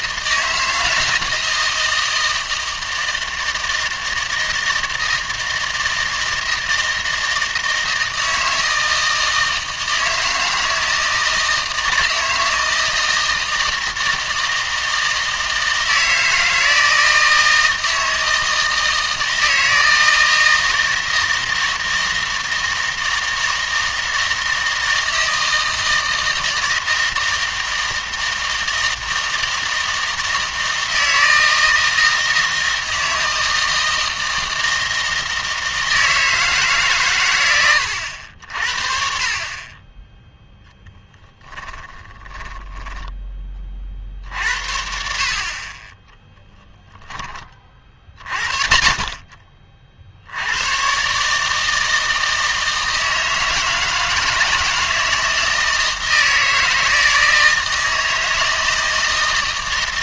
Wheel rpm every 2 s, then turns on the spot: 160, 160, 160, 160, 160, 160, 160, 160, 160, 160, 160, 160, 160, 160, 160, 160, 160, 160, 140, 50, 0, 10, 60, 10, 50, 110, 160, 160, 160, 160.
42-44